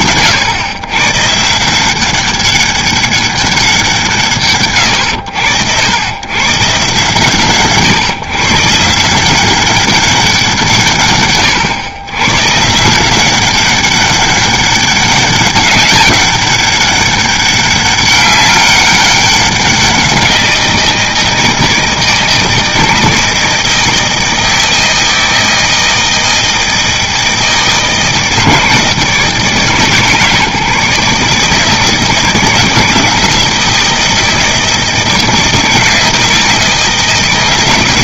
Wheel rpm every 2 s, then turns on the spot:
130, 200, 110, 130, 150, 130, 180, 200, 200, 200, 170, 160, 160, 160, 160, 150, 160, 160, 160.
none